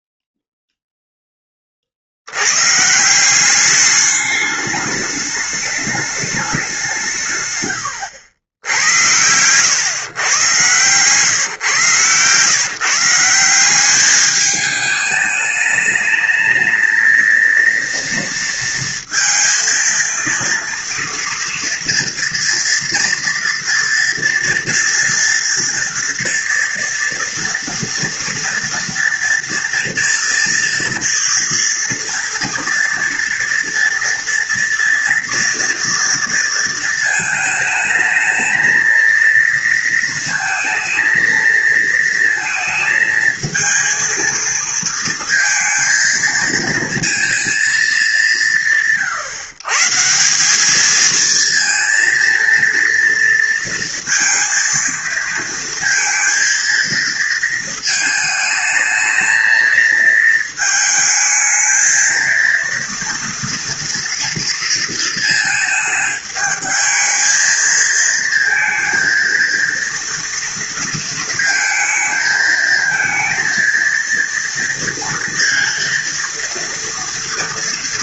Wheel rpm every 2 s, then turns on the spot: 0, 130, 210, 180, 80, 120, 140, 210, 220, 230, 230, 230, 240, 230, 230, 230, 230, 230, 230, 230, 230, 220, 220, 230, 130, 210, 230, 230, 230, 220, 220, 230, 230, 220, 230, 230, 220, 230, 230.
none